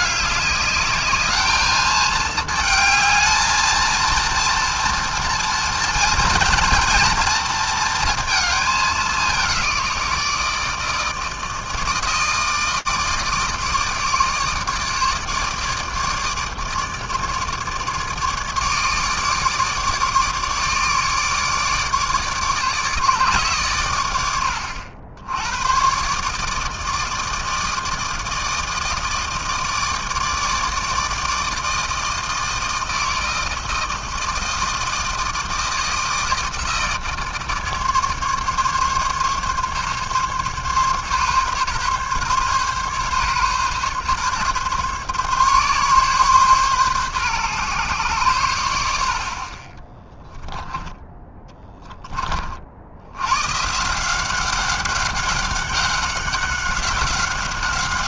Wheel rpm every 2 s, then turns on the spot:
210, 220, 230, 230, 220, 160, 160, 150, 150, 150, 150, 150, 80, 160, 160, 160, 160, 160, 160, 140, 140, 140, 140, 130, 110, 20, 40, 190, 190.
50-52